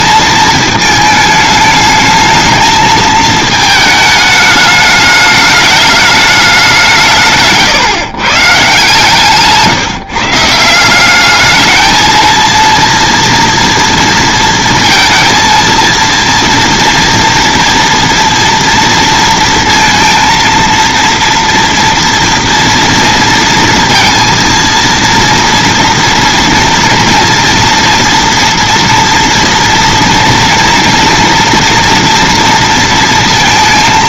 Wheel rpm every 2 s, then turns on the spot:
220, 220, 210, 180, 140, 160, 230, 230, 230, 230, 230, 240, 230, 230, 230, 230, 230.
none